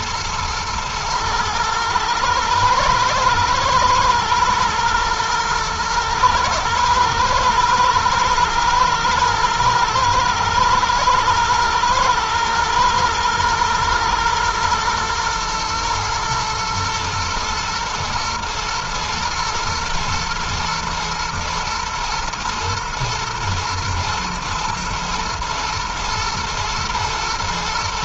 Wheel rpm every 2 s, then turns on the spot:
110, 110, 110, 110, 120, 110, 110, 120, 110, 120, 110, 110, 110, 120.
none